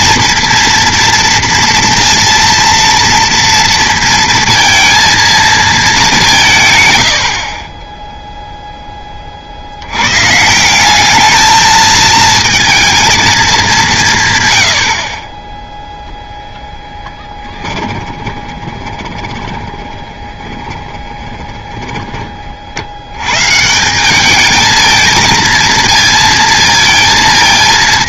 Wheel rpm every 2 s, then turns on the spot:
240, 230, 230, 150, 0, 180, 230, 100, 0, 20, 20, 50, 210, 230.
18-22